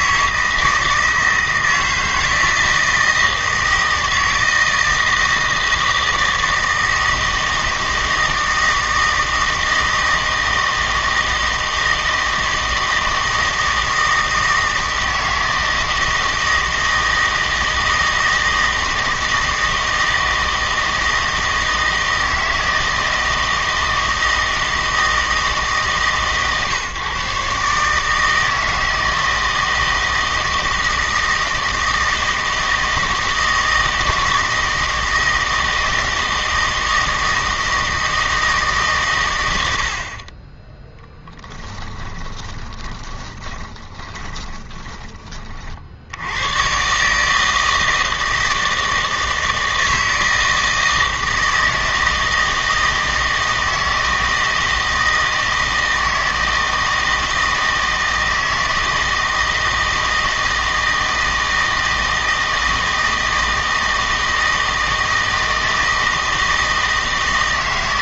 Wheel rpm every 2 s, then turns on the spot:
160, 160, 160, 160, 160, 160, 160, 160, 160, 160, 160, 160, 160, 140, 160, 160, 160, 160, 160, 150, 20, 20, 30, 120, 160, 160, 160, 160, 160, 160, 160, 160, 160, 160.
42-46